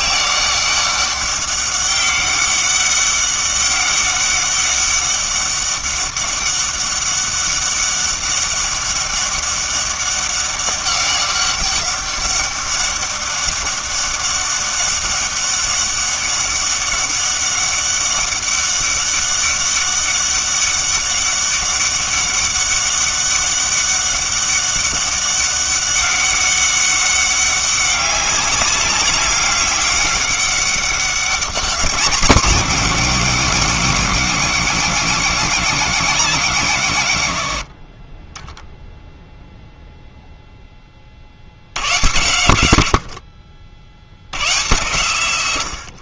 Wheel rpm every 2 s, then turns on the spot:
200, 200, 200, 200, 200, 200, 200, 200, 200, 200, 200, 200, 200, 200, 200, 200, 200, 190, 160, 0, 20, 90, 110.
none